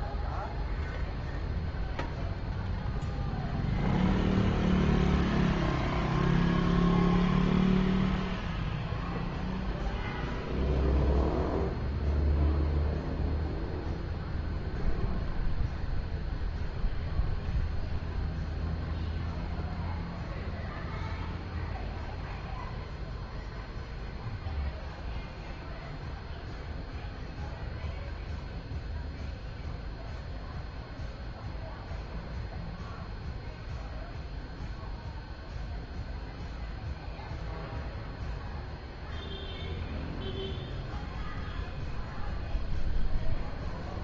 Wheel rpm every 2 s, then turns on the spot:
0, 0, 0, 0, 0, 0, 0, 0, 0, 0, 0, 0, 0, 0, 0, 0, 0, 0, 0, 0, 0, 0.
none